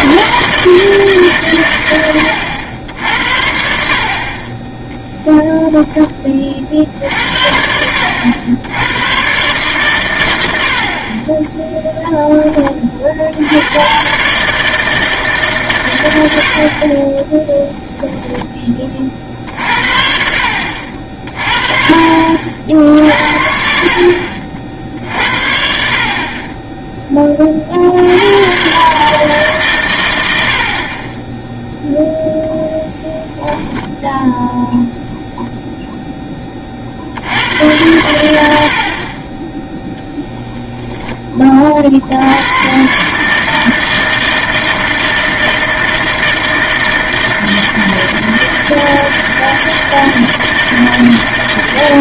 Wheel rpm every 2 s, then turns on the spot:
160, 70, 10, 60, 110, 60, 30, 160, 40, 20, 60, 60, 50, 10, 140, 30, 10, 0, 50, 50, 10, 140, 160, 160, 160, 160.
none